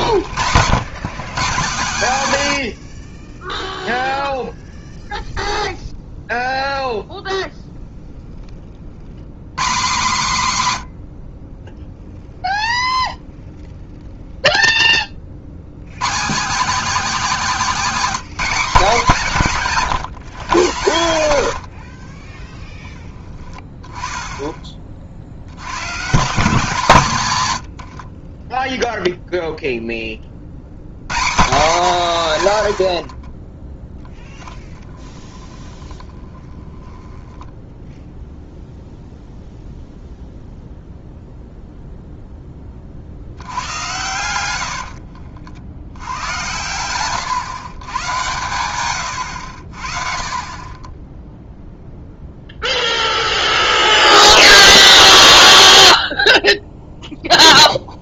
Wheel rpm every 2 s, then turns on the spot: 70, 100, 0, 0, 30, 140, 0, 10, 230, 210, 100, 10, 20, 170, 10, 70, 80, 20, 10, 0, 0, 30, 80, 110, 110, 20, 0, 0, 0.
2-4 20-22 34-38 44-46 48-50